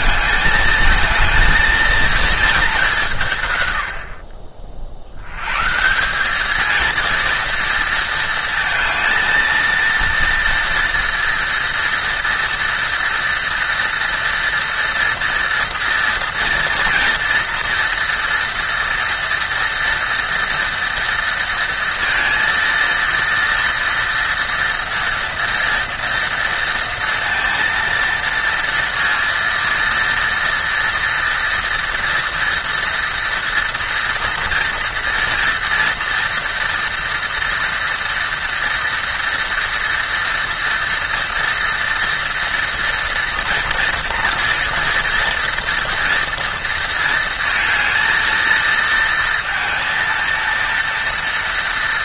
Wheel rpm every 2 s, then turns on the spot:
220, 200, 60, 220, 220, 230, 230, 230, 230, 230, 230, 230, 230, 230, 230, 230, 230, 230, 240, 230, 230, 240, 230, 230, 230, 230.
none